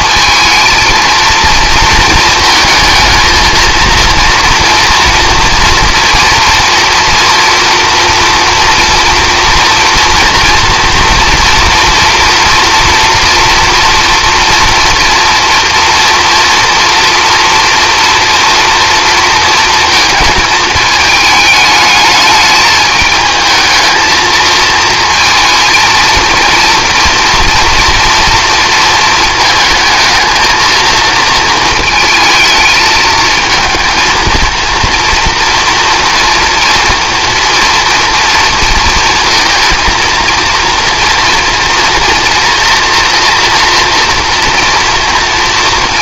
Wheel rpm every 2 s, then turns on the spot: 230, 220, 230, 230, 230, 230, 230, 230, 230, 230, 220, 210, 220, 230, 230, 230, 220, 230, 230, 230, 230, 230, 230.
none